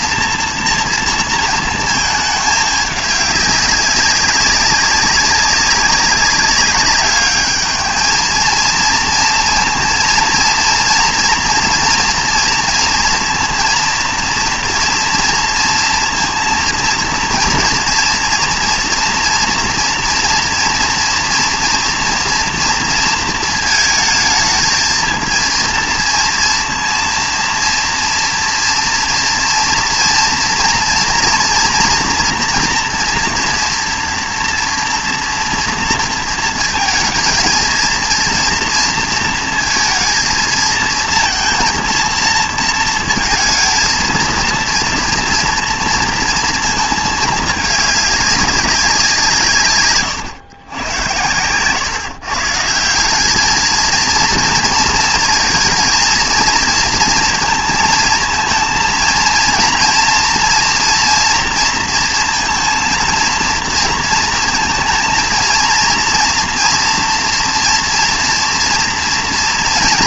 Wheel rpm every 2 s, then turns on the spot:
240, 210, 190, 200, 220, 230, 230, 240, 230, 230, 230, 230, 220, 230, 230, 230, 230, 230, 220, 230, 230, 220, 230, 220, 190, 110, 160, 230, 230, 230, 240, 230, 230, 230, 230.
none